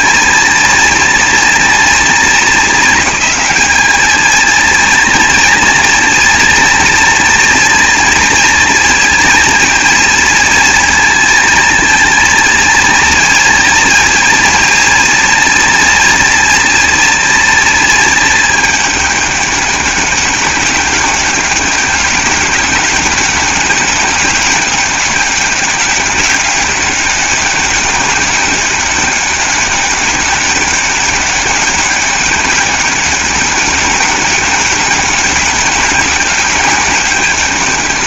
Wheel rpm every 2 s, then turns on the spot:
230, 220, 230, 240, 230, 230, 230, 230, 230, 210, 200, 200, 200, 200, 200, 200, 200, 200, 200.
none